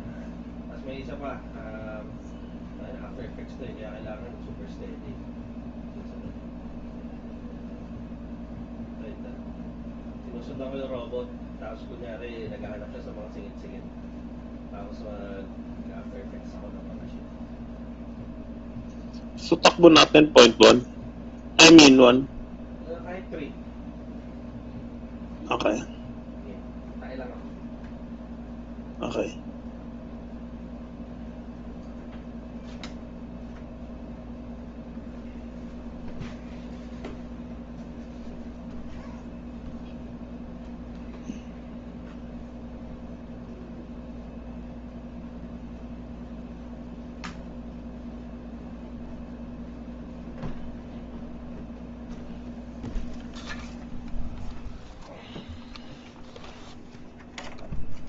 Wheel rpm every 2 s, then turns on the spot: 0, 0, 0, 0, 0, 0, 0, 0, 0, 0, 0, 0, 0, 0, 0, 0, 0, 0, 0, 0, 0, 0, 0, 0, 0, 0, 0, 0, 0.
none